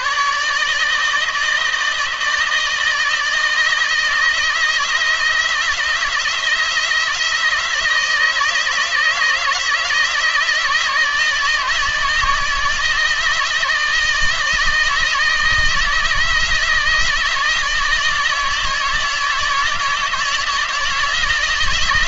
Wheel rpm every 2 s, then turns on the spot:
150, 160, 160, 170, 160, 160, 160, 160, 160, 160, 160.
none